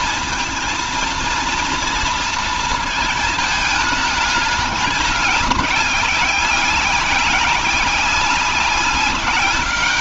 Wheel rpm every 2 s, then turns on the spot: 230, 220, 200, 190, 200.
none